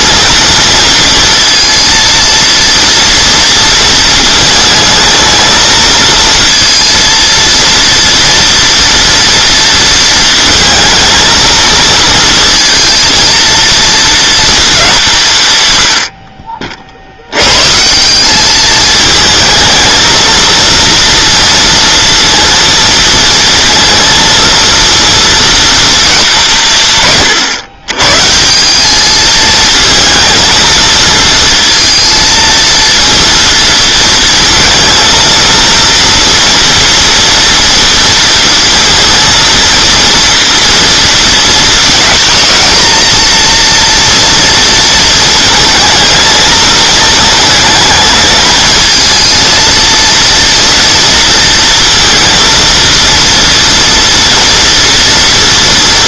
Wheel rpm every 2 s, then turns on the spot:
230, 230, 220, 230, 230, 230, 230, 230, 50, 210, 230, 230, 230, 170, 180, 220, 230, 230, 230, 230, 230, 230, 230, 230, 220, 230, 230, 230.
none